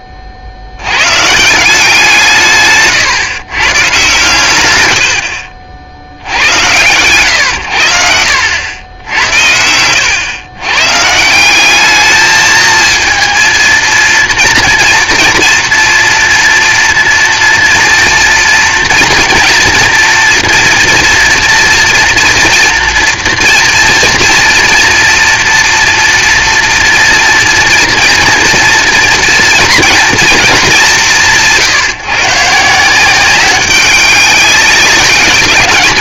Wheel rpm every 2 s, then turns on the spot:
60, 140, 110, 90, 90, 120, 220, 230, 230, 230, 230, 230, 230, 240, 230, 220, 150, 200.
none